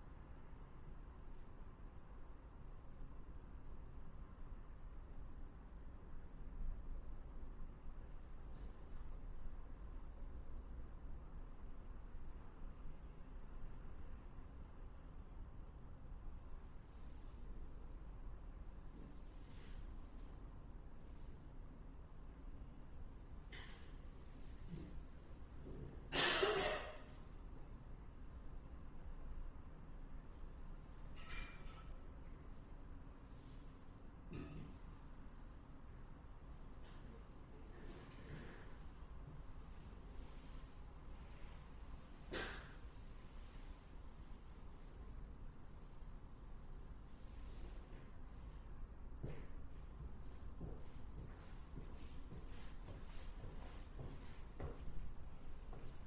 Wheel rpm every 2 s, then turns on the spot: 0, 0, 0, 0, 0, 0, 0, 0, 0, 0, 0, 0, 0, 0, 0, 0, 0, 0, 0, 0, 0, 0, 0, 0, 0, 0, 0, 0.
none